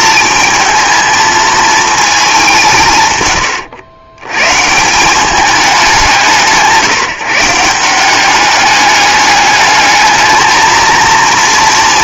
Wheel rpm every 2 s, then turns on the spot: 220, 170, 140, 170, 210, 230.
none